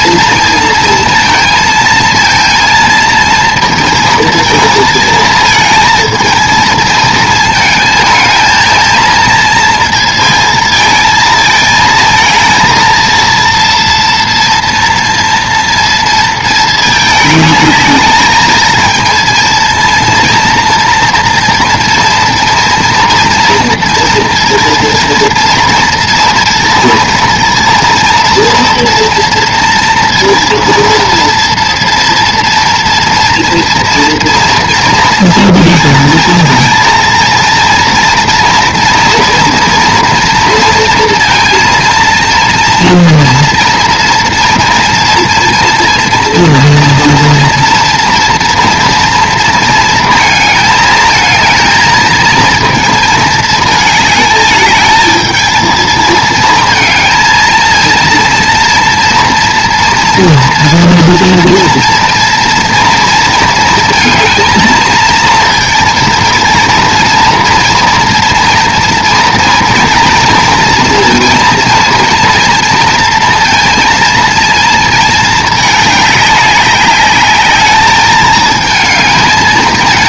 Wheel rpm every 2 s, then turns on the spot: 230, 230, 220, 220, 220, 220, 230, 230, 220, 220, 230, 230, 230, 230, 230, 230, 230, 230, 230, 230, 230, 230, 230, 230, 230, 220, 220, 220, 230, 240, 230, 230, 220, 230, 230, 230, 230, 220, 200, 220.
none